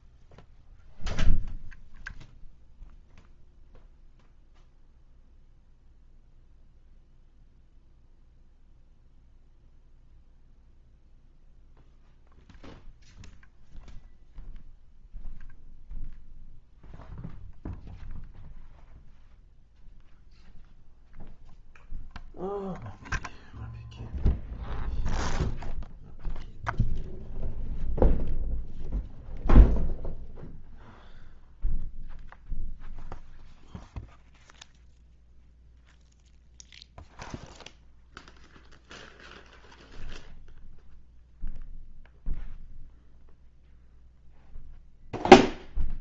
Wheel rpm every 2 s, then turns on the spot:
0, 0, 0, 0, 0, 0, 0, 0, 0, 0, 0, 0, 0, 0, 0, 0, 0, 0, 0, 0, 0, 0, 0.
none